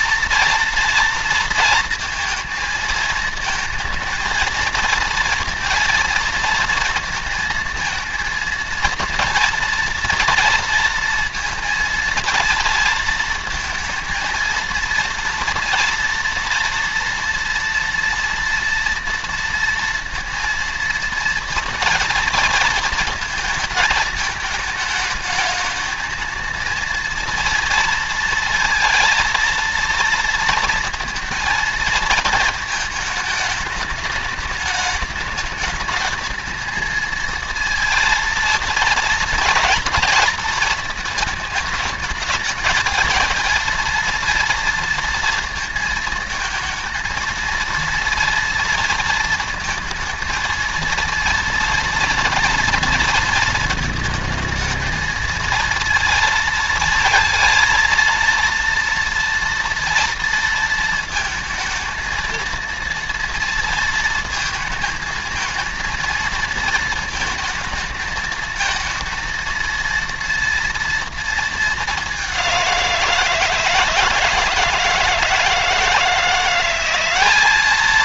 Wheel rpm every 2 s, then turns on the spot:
230, 230, 230, 230, 230, 230, 230, 230, 230, 230, 230, 230, 220, 230, 230, 230, 220, 210, 220, 230, 220, 220, 230, 230, 230, 230, 230, 220, 230, 230, 230, 230, 220, 220, 220, 230, 190, 160, 180.
none